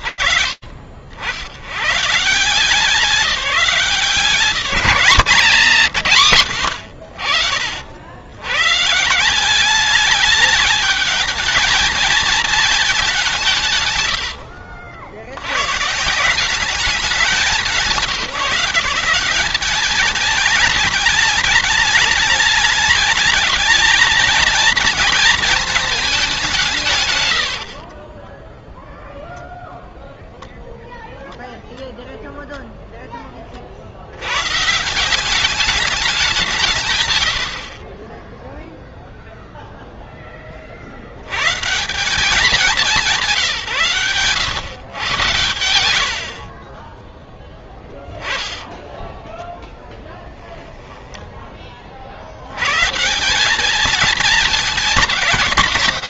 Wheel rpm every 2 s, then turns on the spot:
50, 170, 140, 90, 150, 210, 200, 80, 190, 180, 210, 210, 230, 140, 20, 0, 10, 160, 140, 0, 30, 190, 130, 30, 10, 10, 100, 180.
48-52